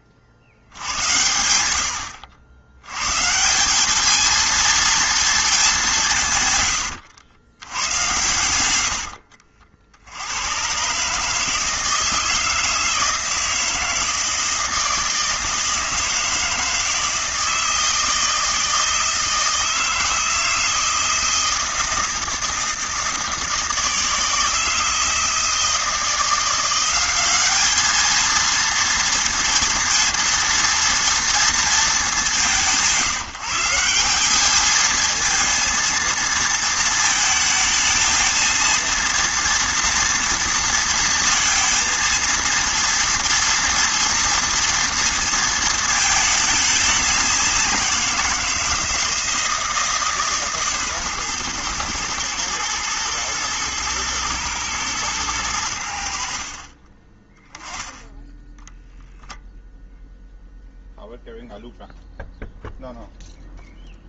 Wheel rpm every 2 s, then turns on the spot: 80, 80, 230, 120, 90, 110, 160, 160, 160, 160, 160, 160, 160, 180, 230, 230, 180, 210, 230, 230, 230, 230, 230, 210, 160, 140, 110, 110, 40, 0, 0, 0.
none